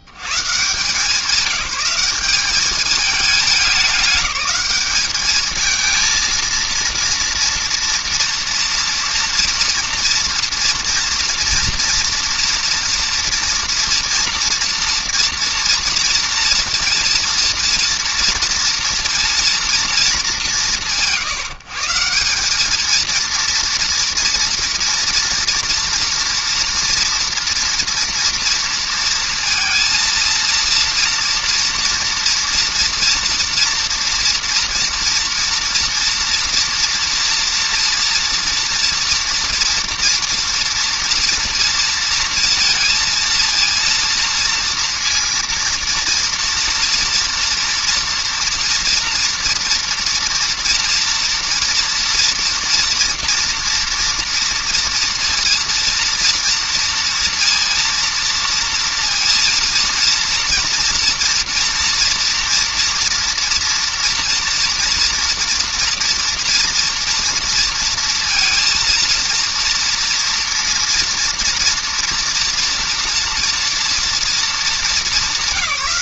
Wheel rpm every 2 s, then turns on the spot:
80, 190, 200, 230, 230, 230, 230, 230, 230, 230, 190, 190, 240, 230, 230, 230, 230, 230, 240, 230, 230, 230, 230, 230, 230, 230, 230, 230, 230, 230, 230, 230, 230, 240, 230, 230, 230, 220.
none